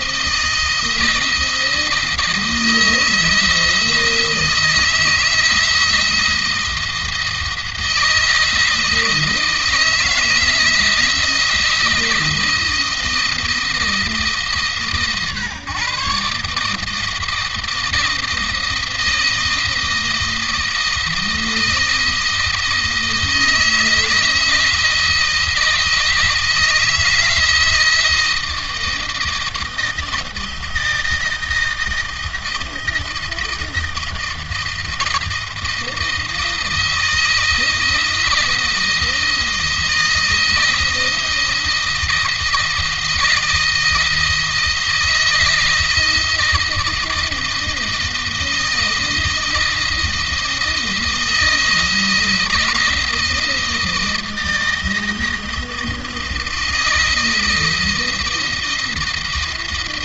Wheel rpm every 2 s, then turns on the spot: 160, 160, 160, 170, 160, 160, 160, 150, 150, 160, 160, 160, 160, 170, 160, 160, 170, 160, 160, 170, 160, 160, 170, 160, 160, 170, 160, 160, 160, 160.
none